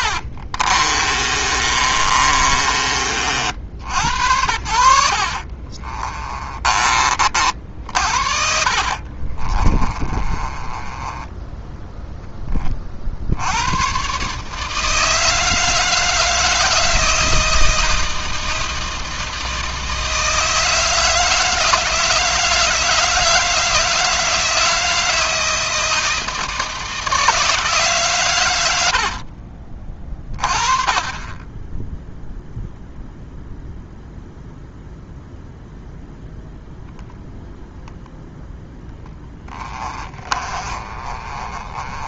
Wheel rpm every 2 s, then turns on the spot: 30, 40, 70, 30, 50, 20, 50, 160, 160, 160, 160, 160, 160, 160, 80, 30, 0, 0, 0, 10, 30.
0-2 4-6 8-12 28-30 38-42